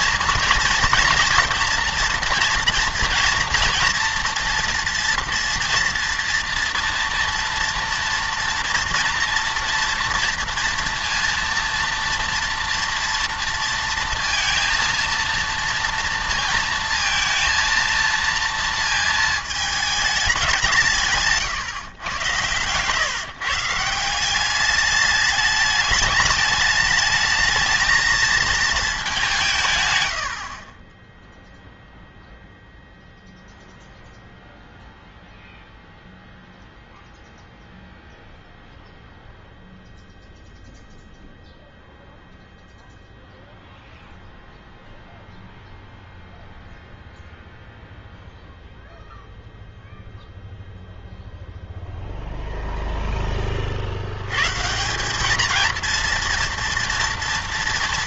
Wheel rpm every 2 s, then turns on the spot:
230, 230, 230, 230, 230, 230, 230, 230, 230, 230, 180, 110, 200, 210, 220, 30, 0, 0, 0, 0, 0, 0, 0, 0, 0, 0, 0, 150, 230.
none